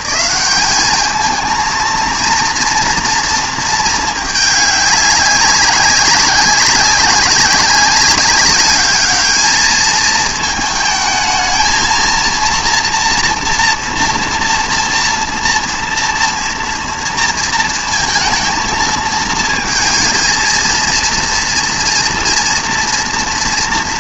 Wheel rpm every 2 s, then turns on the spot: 200, 230, 200, 190, 200, 220, 230, 230, 230, 230, 230, 230.
none